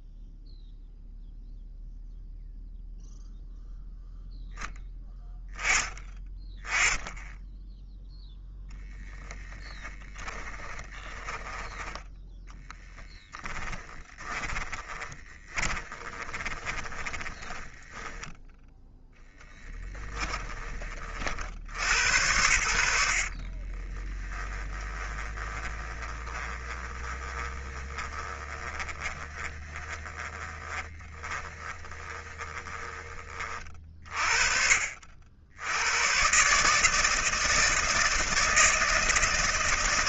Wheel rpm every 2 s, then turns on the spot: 0, 0, 10, 20, 0, 10, 10, 20, 20, 10, 30, 70, 10, 20, 20, 10, 20, 50, 140, 160.
10-18 24-34